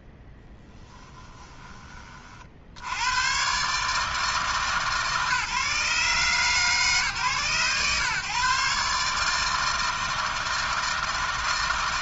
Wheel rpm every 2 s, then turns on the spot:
10, 70, 150, 140, 140, 160.
0-2